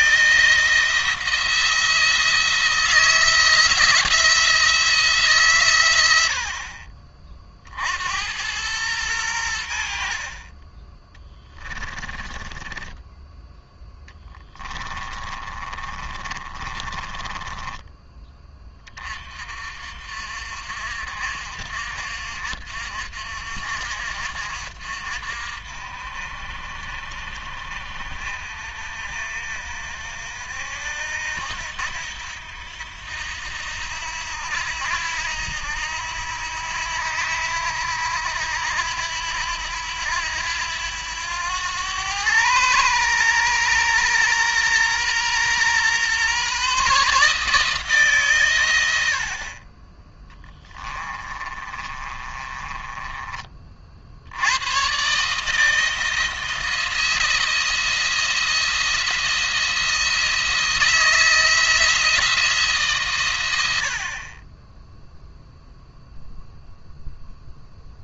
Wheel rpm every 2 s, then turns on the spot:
160, 160, 160, 50, 100, 20, 10, 20, 30, 30, 60, 60, 60, 60, 60, 70, 80, 80, 80, 80, 90, 110, 120, 140, 90, 20, 20, 120, 170, 170, 160, 140, 10, 0.
12-18 50-54